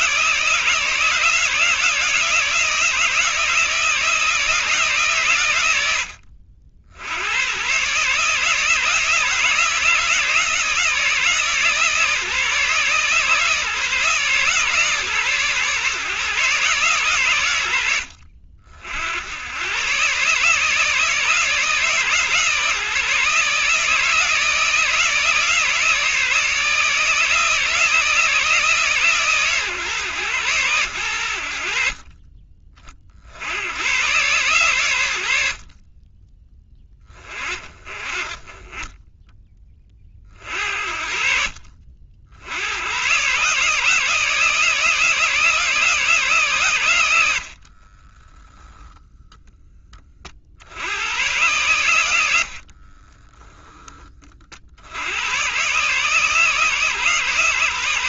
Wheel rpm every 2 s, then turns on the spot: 160, 160, 140, 90, 160, 160, 150, 140, 130, 70, 160, 150, 160, 160, 140, 100, 50, 100, 20, 20, 50, 120, 160, 100, 0, 110, 20, 90, 140.
52-54